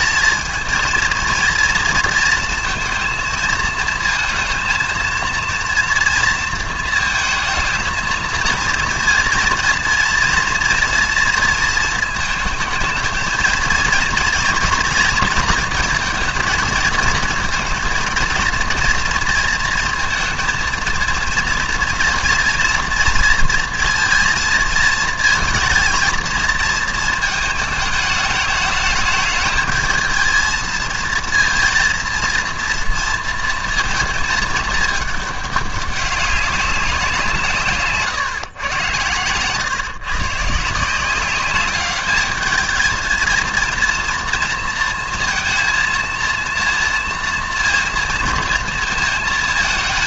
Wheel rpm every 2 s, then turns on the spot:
220, 230, 230, 220, 230, 230, 220, 240, 230, 230, 220, 230, 230, 230, 210, 230, 230, 210, 200, 120, 160, 220, 230, 230, 230.
none